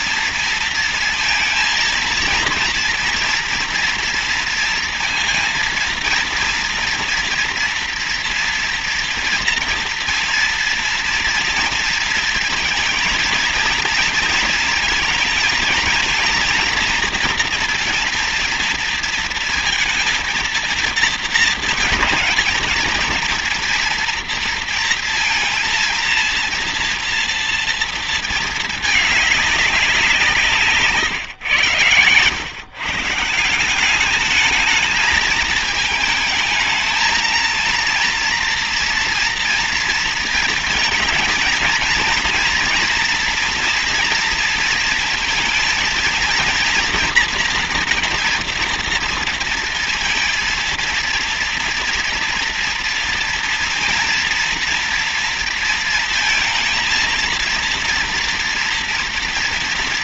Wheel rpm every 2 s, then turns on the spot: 230, 230, 230, 230, 230, 230, 230, 230, 230, 230, 230, 230, 230, 230, 220, 170, 130, 210, 220, 230, 220, 240, 230, 230, 230, 230, 230, 240, 230, 230.
none